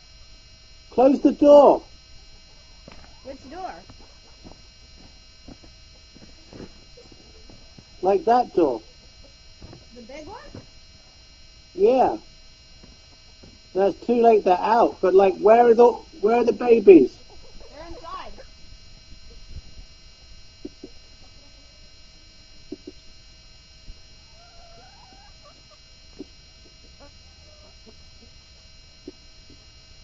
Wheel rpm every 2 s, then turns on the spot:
0, 0, 0, 0, 0, 0, 0, 0, 0, 0, 0, 0, 0, 0, 0.
none